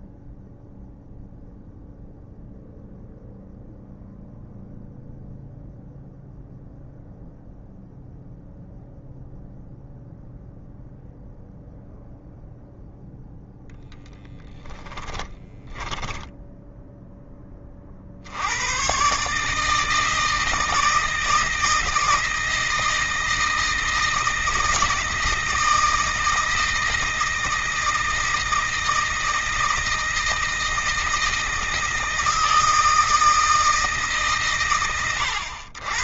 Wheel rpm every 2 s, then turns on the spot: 0, 0, 0, 0, 0, 0, 0, 10, 10, 140, 160, 160, 160, 160, 160, 160, 160, 120.
14-16